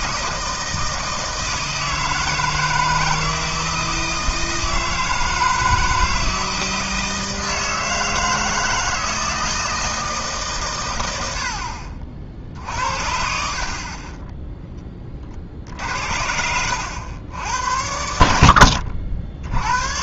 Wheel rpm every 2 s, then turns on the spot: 160, 160, 160, 160, 160, 120, 60, 10, 80, 80.
none